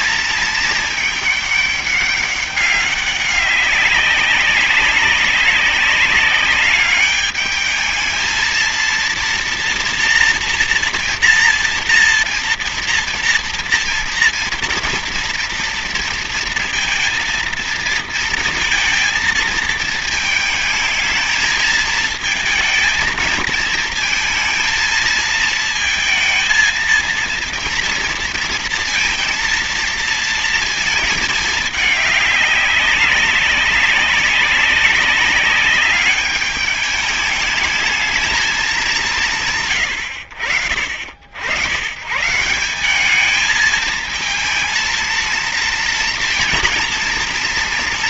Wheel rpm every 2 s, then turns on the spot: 220, 200, 200, 200, 230, 230, 230, 230, 230, 230, 220, 220, 220, 230, 230, 220, 200, 200, 210, 200, 60, 180, 220, 230.
none